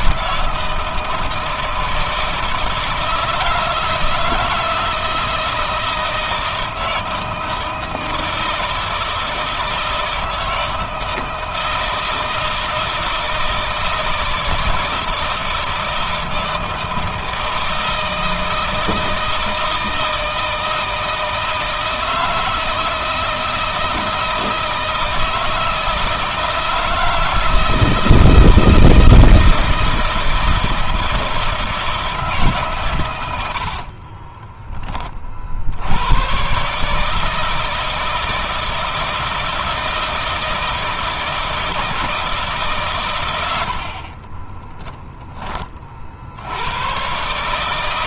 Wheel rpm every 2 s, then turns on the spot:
170, 160, 160, 160, 160, 160, 160, 160, 160, 160, 160, 160, 160, 160, 160, 160, 140, 20, 130, 160, 160, 150, 30, 80.
44-46